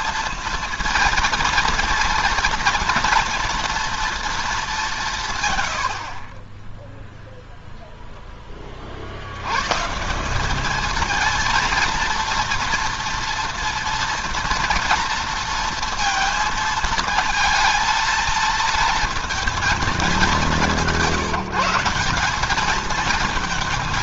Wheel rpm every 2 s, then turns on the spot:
230, 230, 170, 0, 60, 220, 240, 240, 230, 230, 170, 220.
none